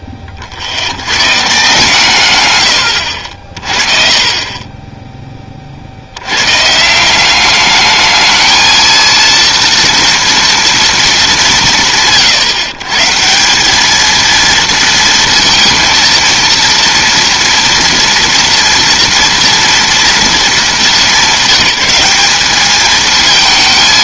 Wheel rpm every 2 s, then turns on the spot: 120, 50, 10, 190, 230, 210, 160, 230, 230, 230, 200, 220.
none